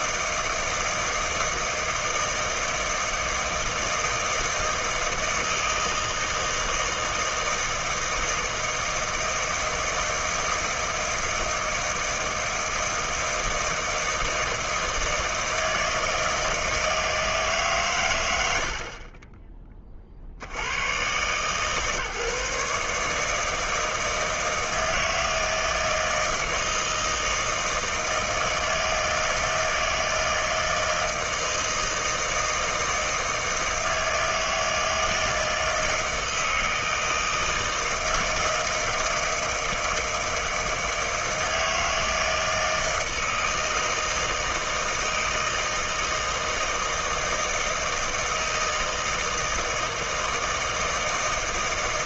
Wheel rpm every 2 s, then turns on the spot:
160, 160, 160, 160, 160, 160, 160, 160, 160, 60, 110, 150, 160, 160, 160, 160, 160, 160, 160, 160, 160, 160, 160, 160, 160, 160.
none